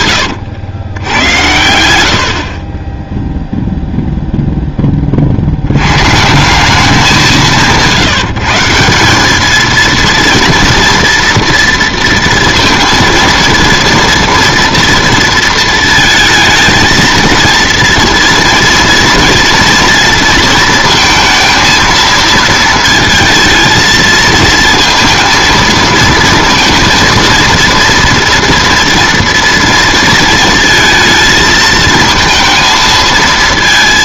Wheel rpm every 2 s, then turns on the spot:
100, 50, 10, 180, 170, 230, 230, 230, 230, 230, 230, 230, 220, 230, 230, 220, 220.
none